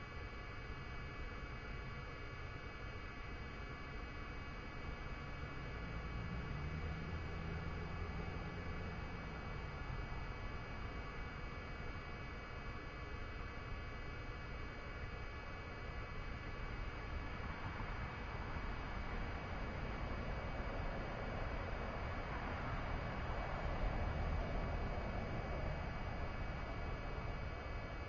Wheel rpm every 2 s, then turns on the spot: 0, 0, 0, 0, 0, 0, 0, 0, 0, 0, 0, 0, 0, 0.
none